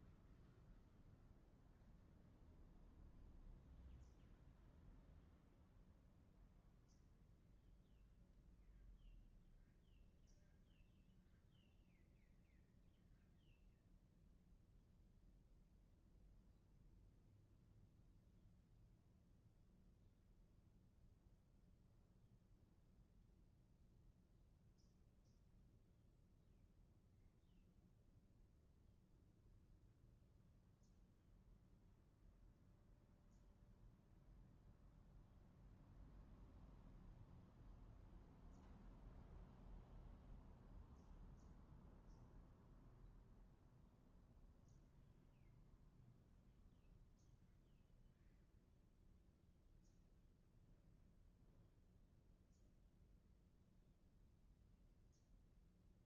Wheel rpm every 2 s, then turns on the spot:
0, 0, 0, 0, 0, 0, 0, 0, 0, 0, 0, 0, 0, 0, 0, 0, 0, 0, 0, 0, 0, 0, 0, 0, 0, 0, 0, 0.
none